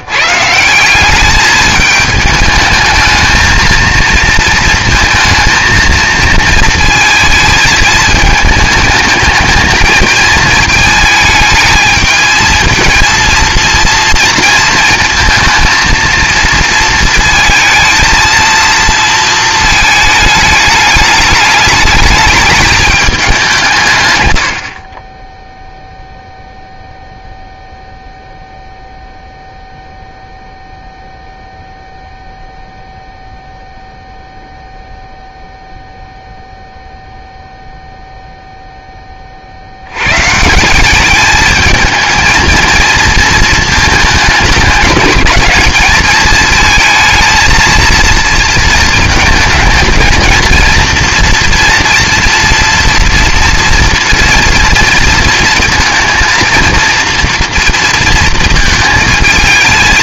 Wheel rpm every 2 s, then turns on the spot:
170, 210, 230, 230, 220, 230, 220, 230, 230, 230, 210, 220, 80, 0, 0, 0, 0, 0, 0, 0, 170, 230, 210, 220, 220, 230, 230, 230, 230, 230.
none